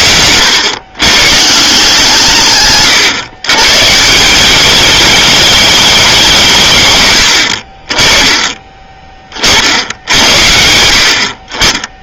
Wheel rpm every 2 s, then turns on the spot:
130, 140, 210, 130, 30, 70.
none